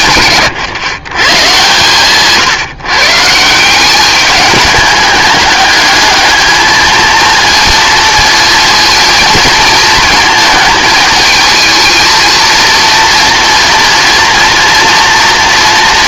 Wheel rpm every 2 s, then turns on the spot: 130, 140, 210, 220, 230, 220, 230, 230.
none